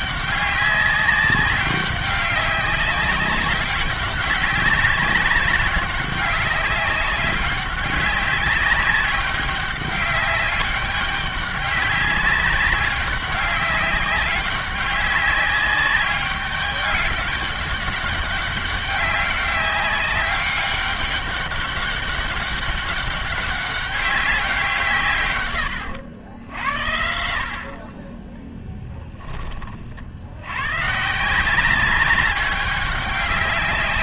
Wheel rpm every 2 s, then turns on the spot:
200, 190, 190, 200, 200, 200, 200, 200, 200, 190, 200, 200, 170, 90, 10, 120, 200.
none